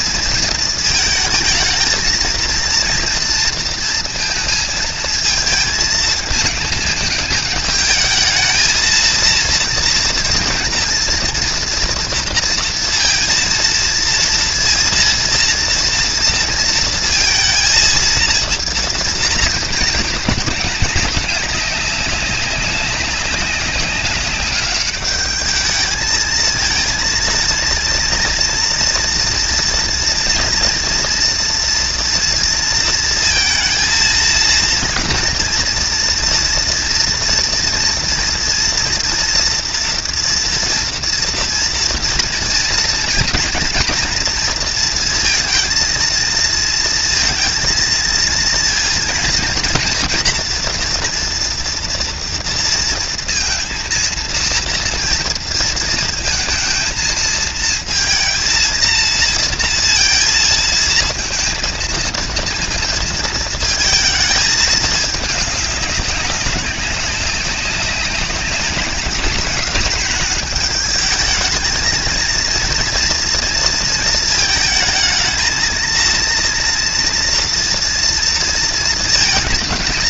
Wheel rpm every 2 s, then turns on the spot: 220, 230, 220, 220, 230, 240, 230, 230, 230, 230, 200, 190, 200, 230, 230, 230, 230, 230, 240, 230, 230, 240, 230, 230, 230, 240, 230, 230, 230, 230, 230, 230, 210, 190, 210, 220, 230, 220, 230, 230.
none